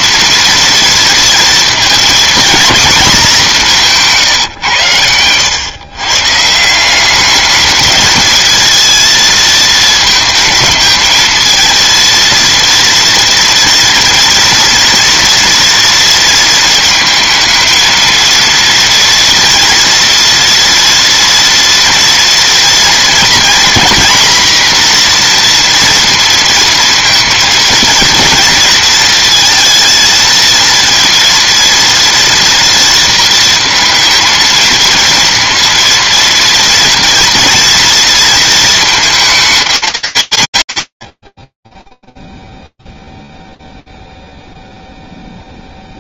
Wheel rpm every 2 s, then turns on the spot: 230, 240, 120, 160, 230, 220, 230, 230, 230, 240, 230, 240, 240, 230, 220, 230, 230, 230, 230, 230, 100, 0, 0.
none